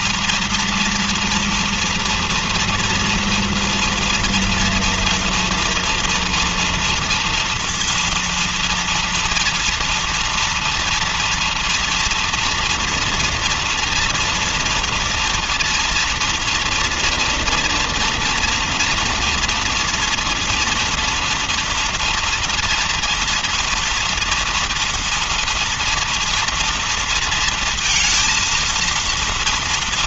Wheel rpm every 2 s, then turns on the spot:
230, 240, 230, 230, 230, 230, 230, 230, 230, 230, 230, 230, 230, 230, 230.
none